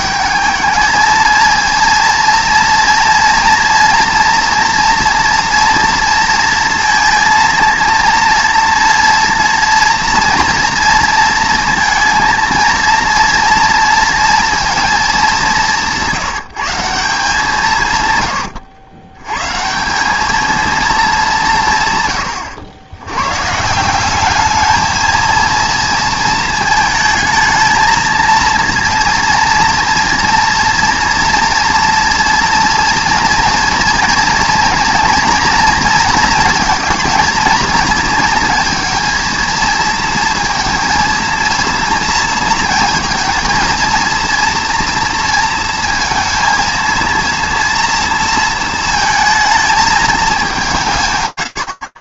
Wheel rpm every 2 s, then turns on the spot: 210, 230, 230, 230, 230, 230, 230, 240, 170, 90, 220, 100, 210, 220, 230, 230, 240, 230, 220, 230, 230, 230, 230, 230, 230, 200.
none